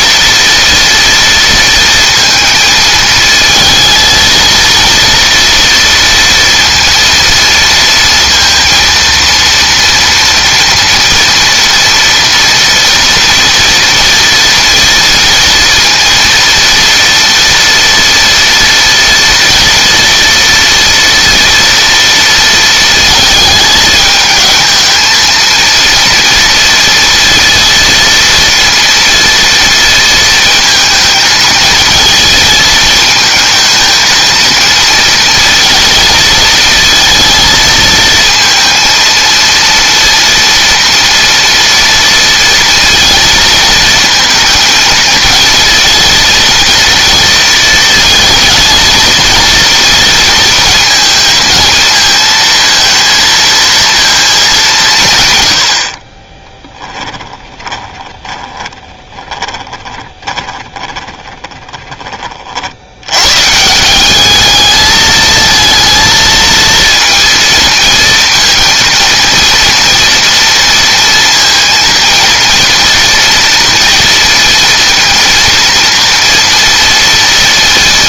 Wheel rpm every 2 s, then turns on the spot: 230, 230, 230, 230, 230, 230, 230, 230, 240, 230, 230, 220, 220, 230, 230, 220, 220, 230, 220, 230, 230, 230, 220, 230, 230, 230, 230, 160, 10, 20, 20, 70, 220, 230, 230, 230, 230, 230, 230.
56-62